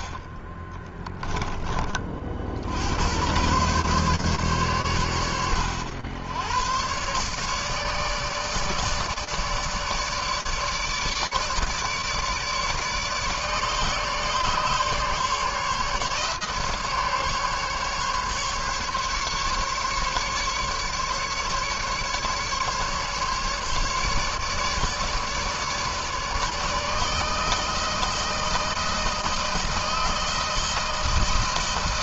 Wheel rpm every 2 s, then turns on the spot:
20, 70, 120, 110, 150, 150, 150, 150, 150, 150, 140, 140, 150, 150, 160, 160.
none